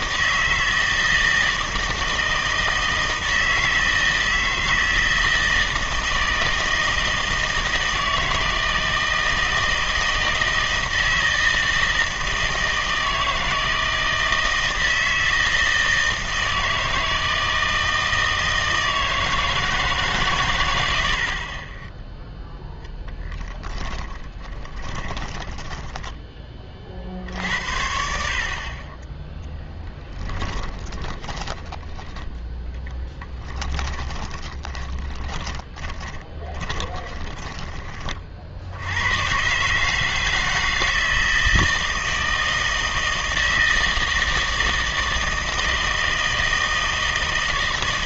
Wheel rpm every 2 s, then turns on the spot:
160, 160, 160, 160, 160, 160, 160, 160, 160, 160, 110, 0, 20, 40, 30, 20, 10, 20, 20, 70, 160, 160, 160, 160.
24-26 30-32 34-38